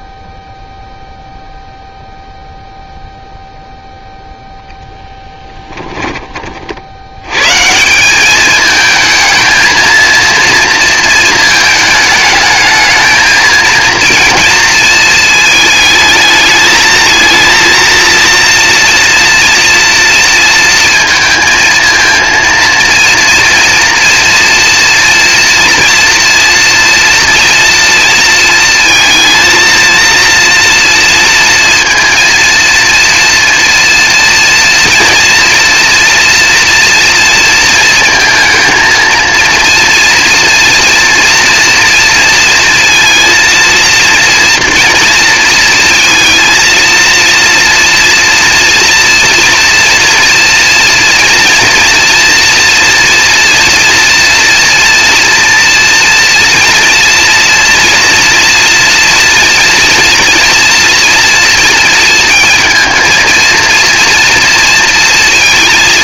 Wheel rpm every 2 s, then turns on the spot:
0, 0, 0, 30, 210, 230, 210, 230, 220, 230, 230, 230, 230, 230, 230, 230, 230, 230, 230, 220, 240, 230, 230, 230, 230, 230, 240, 230, 230, 230, 230, 220, 230.
none